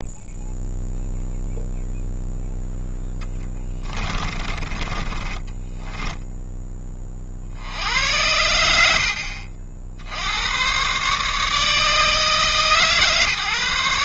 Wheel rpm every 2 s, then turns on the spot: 0, 10, 20, 30, 50, 140, 130.
2-6